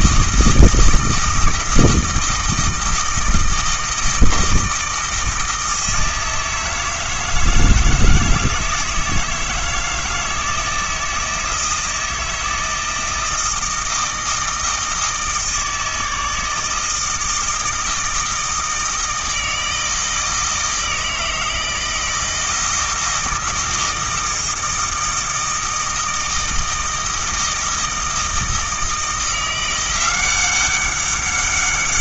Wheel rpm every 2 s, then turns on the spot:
160, 160, 160, 160, 160, 160, 160, 160, 160, 160, 160, 160, 160, 160, 160, 190.
none